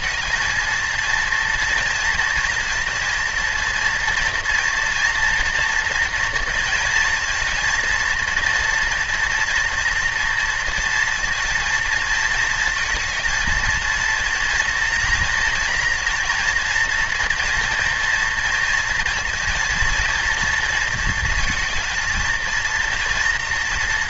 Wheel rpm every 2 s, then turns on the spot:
230, 230, 240, 230, 230, 230, 220, 230, 230, 230, 230, 240.
none